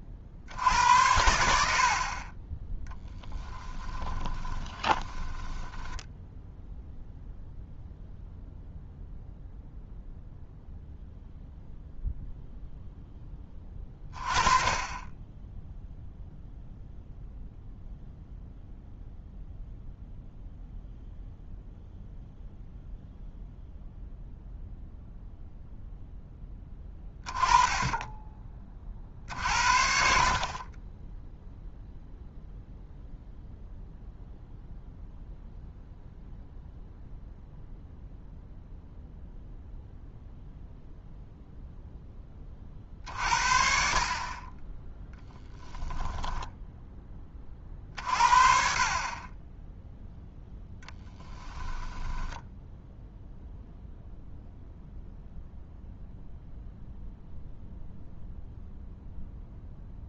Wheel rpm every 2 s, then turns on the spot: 70, 10, 10, 0, 0, 0, 0, 20, 0, 0, 0, 0, 0, 10, 30, 30, 0, 0, 0, 0, 0, 40, 10, 10, 40, 10, 0, 0, 0, 0.
4-6 50-52